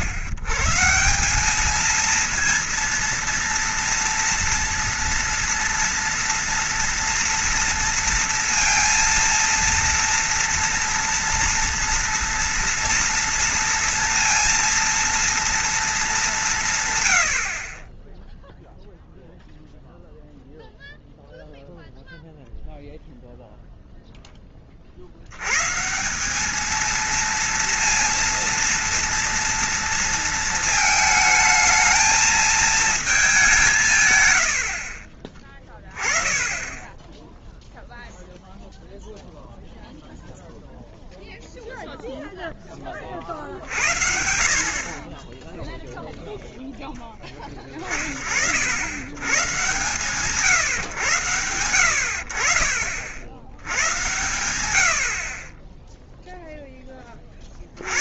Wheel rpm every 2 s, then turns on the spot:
130, 230, 230, 230, 230, 230, 230, 230, 170, 0, 0, 0, 30, 220, 230, 220, 220, 80, 10, 0, 0, 10, 50, 0, 70, 130, 40, 100, 10.
none